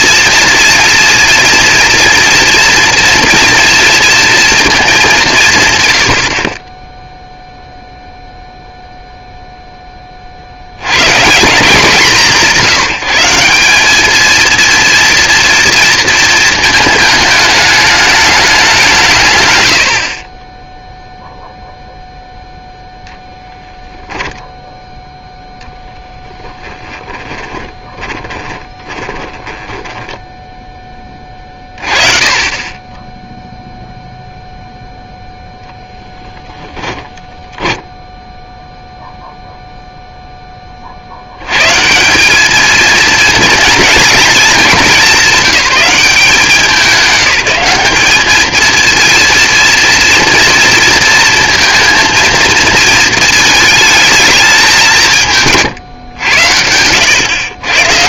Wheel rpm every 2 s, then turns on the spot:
230, 240, 200, 10, 0, 80, 150, 230, 230, 190, 10, 0, 0, 10, 20, 10, 20, 0, 10, 0, 30, 220, 200, 190, 230, 230, 230, 180, 90.
26-30 36-38